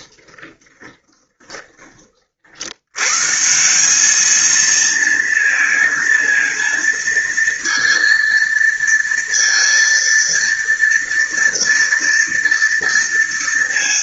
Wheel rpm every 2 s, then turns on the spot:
10, 80, 220, 230, 230, 230, 230.
0-2